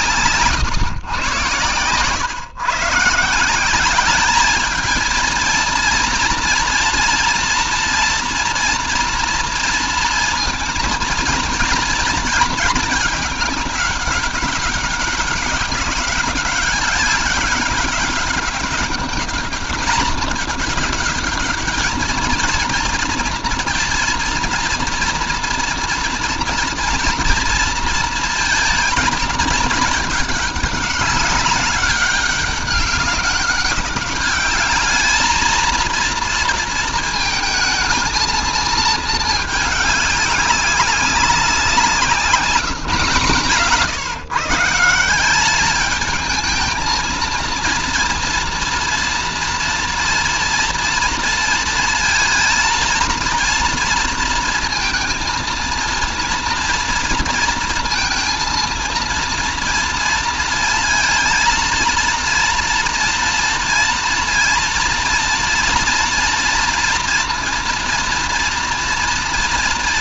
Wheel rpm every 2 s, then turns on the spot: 120, 150, 220, 230, 230, 230, 220, 200, 200, 210, 210, 230, 240, 230, 230, 200, 200, 220, 230, 220, 200, 160, 180, 230, 230, 230, 230, 220, 230, 230, 230, 230, 230, 230, 230.
none